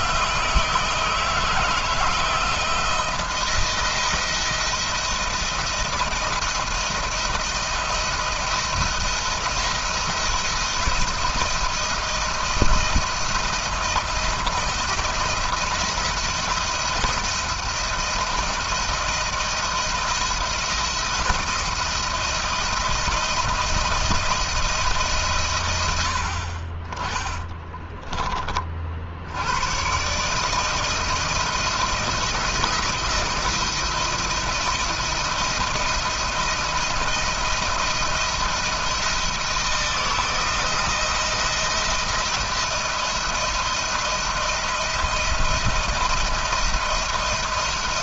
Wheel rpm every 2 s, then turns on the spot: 160, 170, 170, 170, 170, 170, 170, 170, 170, 170, 170, 170, 150, 30, 60, 160, 170, 170, 170, 170, 170, 170, 170, 170.
none